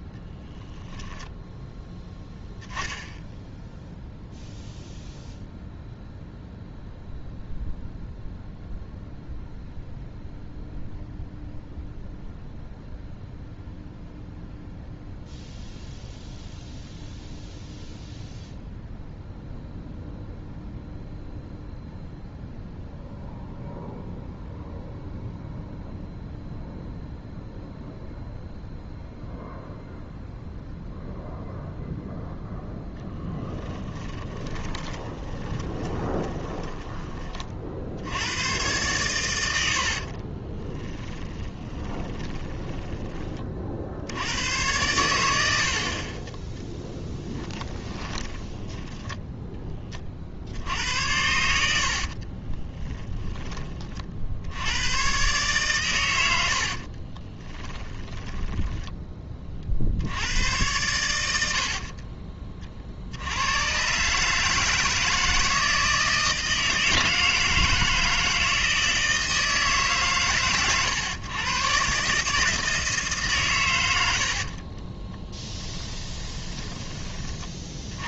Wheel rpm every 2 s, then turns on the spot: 10, 10, 0, 0, 0, 0, 0, 0, 0, 0, 0, 0, 0, 0, 0, 0, 0, 20, 20, 110, 30, 20, 100, 10, 10, 80, 30, 90, 50, 10, 100, 40, 160, 160, 160, 130, 160, 40, 20.
34-38 40-44 46-50 52-54 56-58 74-78